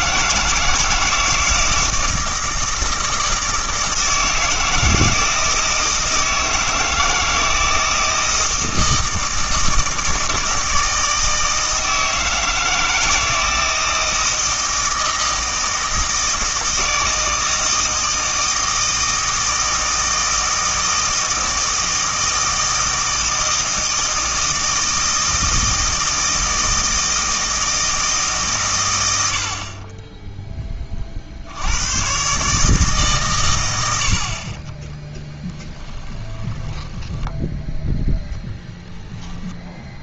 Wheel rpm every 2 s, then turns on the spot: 160, 160, 160, 160, 160, 160, 160, 160, 160, 160, 160, 160, 160, 160, 120, 10, 150, 30, 10, 10.
34-38